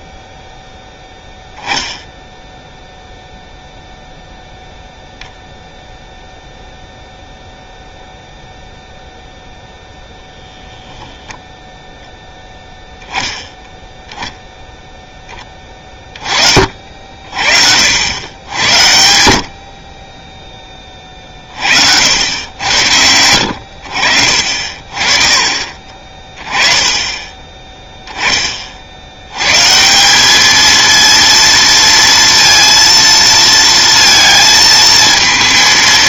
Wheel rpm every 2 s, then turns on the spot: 0, 0, 0, 0, 0, 10, 10, 0, 50, 90, 20, 90, 50, 30, 50, 220, 230, 230.
none